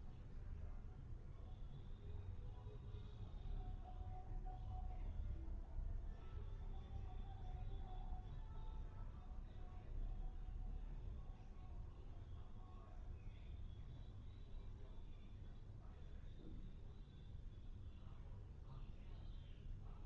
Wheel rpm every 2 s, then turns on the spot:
0, 0, 0, 0, 0, 0, 0, 0, 0, 0.
none